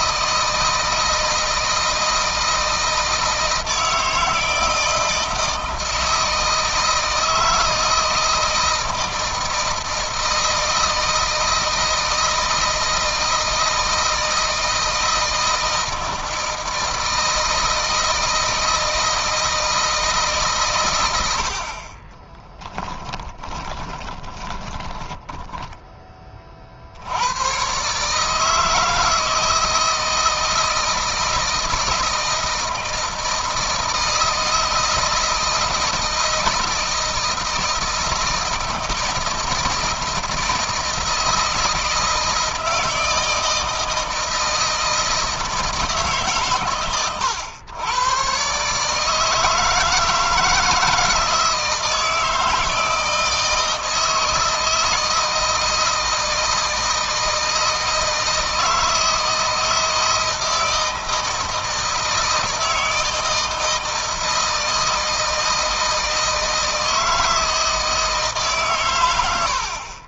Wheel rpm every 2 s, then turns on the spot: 160, 160, 160, 160, 160, 160, 160, 160, 160, 160, 130, 20, 20, 30, 150, 160, 160, 160, 160, 160, 160, 160, 160, 140, 140, 160, 160, 160, 160, 160, 160, 160, 160, 160, 150.
22-26